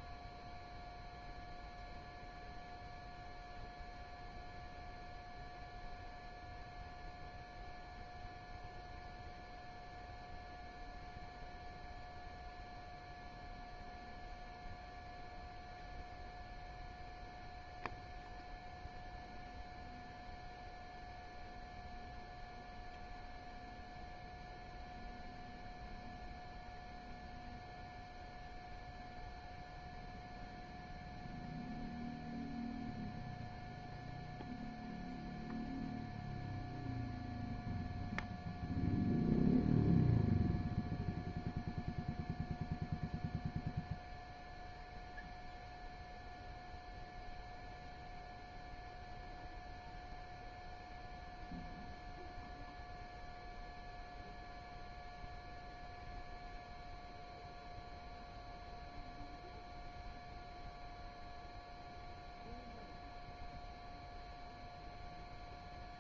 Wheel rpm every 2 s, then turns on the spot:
0, 0, 0, 0, 0, 0, 0, 0, 0, 0, 0, 0, 0, 0, 0, 0, 0, 0, 0, 0, 0, 0, 0, 0, 0, 0, 0, 0, 0, 0, 0, 0, 0.
none